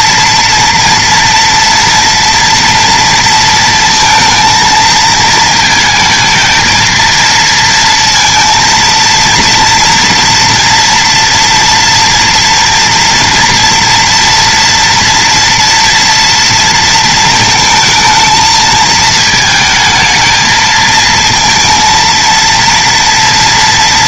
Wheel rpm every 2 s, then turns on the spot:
230, 230, 230, 230, 230, 230, 230, 230, 230, 220, 230, 230.
none